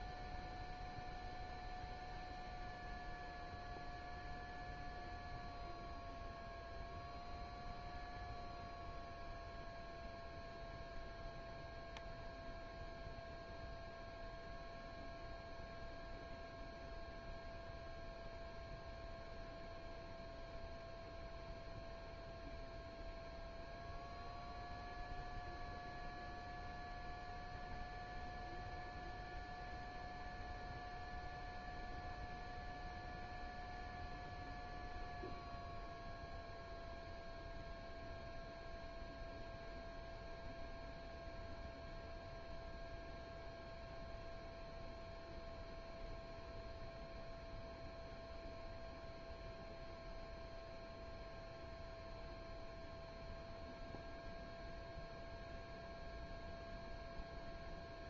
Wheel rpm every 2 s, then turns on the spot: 0, 0, 0, 0, 0, 0, 0, 0, 0, 0, 0, 0, 0, 0, 0, 0, 0, 0, 0, 0, 0, 0, 0, 0, 0, 0, 0, 0, 0.
none